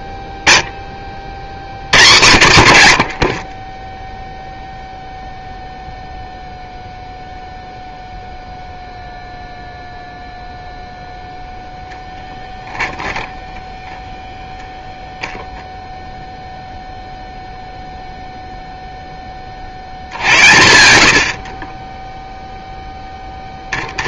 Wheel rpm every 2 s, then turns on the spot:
10, 80, 0, 0, 0, 0, 0, 0, 0, 0, 90, 0.
none